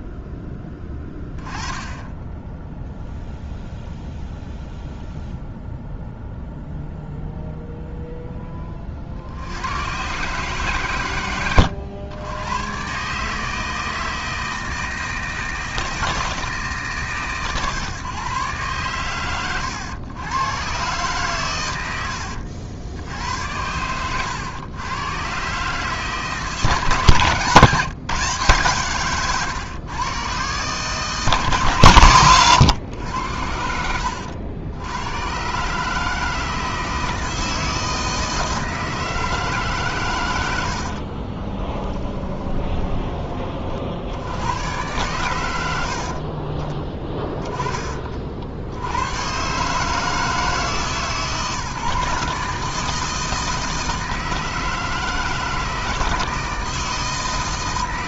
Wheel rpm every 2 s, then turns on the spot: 10, 0, 0, 0, 30, 130, 120, 160, 140, 120, 120, 80, 110, 150, 150, 140, 100, 90, 160, 160, 70, 20, 110, 20, 80, 150, 160, 160, 160.
40-44